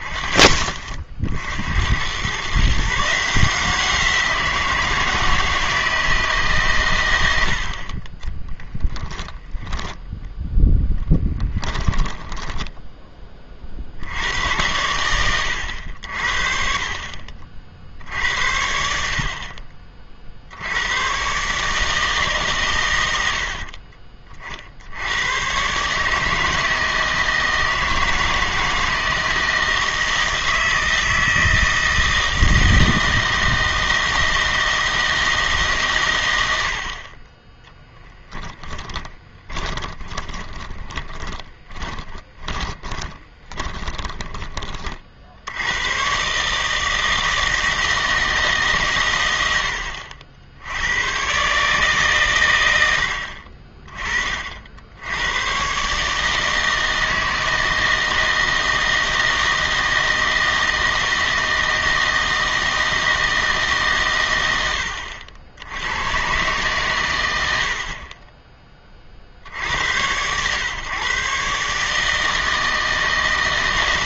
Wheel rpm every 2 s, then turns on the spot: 30, 140, 170, 130, 20, 10, 10, 90, 50, 60, 80, 130, 60, 160, 160, 160, 160, 160, 80, 10, 20, 10, 30, 150, 140, 80, 110, 60, 160, 160, 160, 160, 80, 120, 20, 120, 160.
12-14 38-44